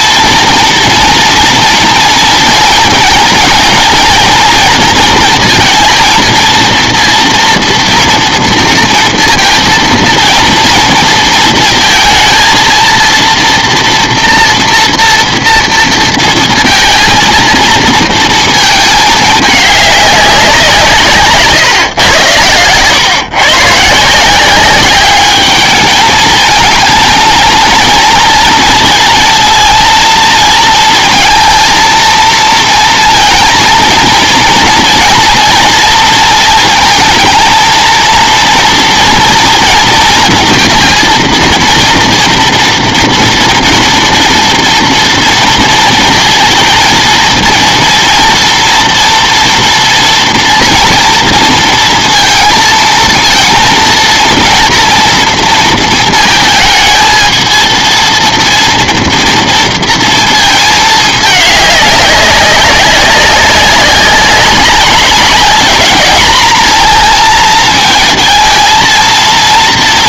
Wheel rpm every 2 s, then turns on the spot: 230, 230, 230, 230, 230, 230, 230, 240, 230, 220, 180, 120, 190, 220, 230, 230, 230, 230, 230, 230, 230, 230, 230, 230, 230, 230, 230, 230, 220, 240, 220, 200, 190, 220, 230.
none